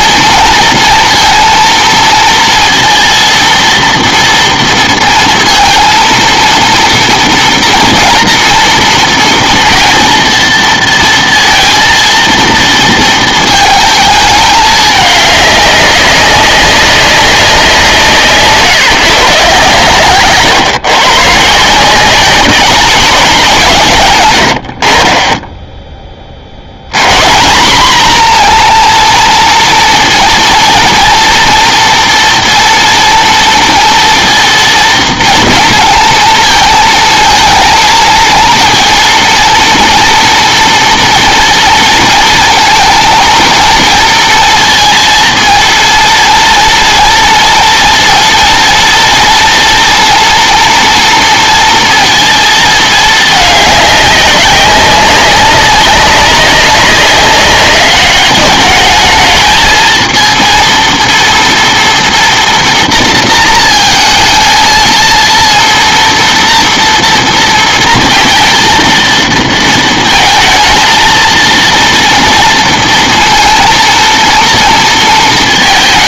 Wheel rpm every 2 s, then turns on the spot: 230, 230, 230, 230, 230, 230, 230, 210, 200, 150, 130, 190, 80, 100, 240, 230, 230, 230, 220, 230, 240, 230, 230, 230, 230, 230, 220, 190, 190, 210, 230, 230, 220, 230, 230, 220, 230, 230.
none